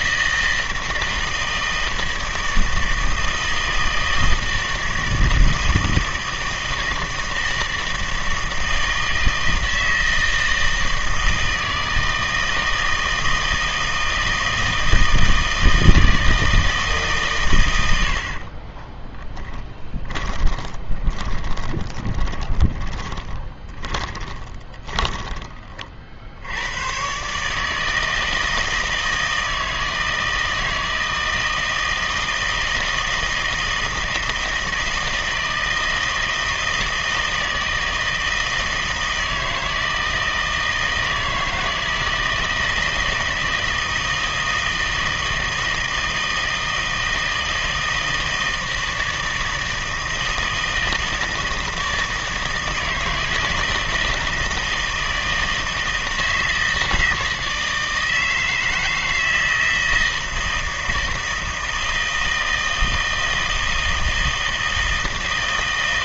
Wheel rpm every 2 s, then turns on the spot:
160, 160, 160, 160, 160, 160, 160, 160, 160, 40, 20, 20, 20, 110, 160, 160, 160, 160, 160, 160, 160, 160, 160, 160, 160, 160, 160, 160, 160, 160, 160, 160, 160.
18-26